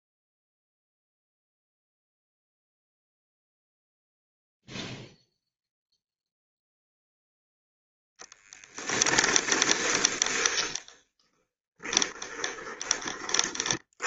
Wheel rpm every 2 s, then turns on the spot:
0, 0, 0, 0, 10, 10, 20.
8-14